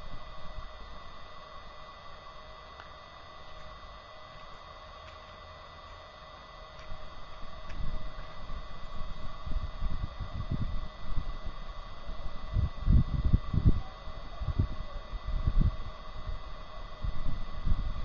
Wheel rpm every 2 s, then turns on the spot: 0, 0, 0, 0, 0, 0, 0, 0, 0.
none